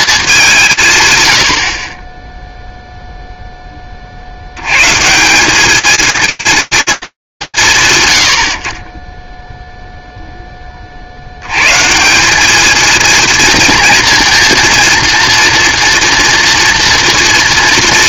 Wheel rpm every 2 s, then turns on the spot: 140, 0, 120, 230, 80, 30, 220, 230, 240.
none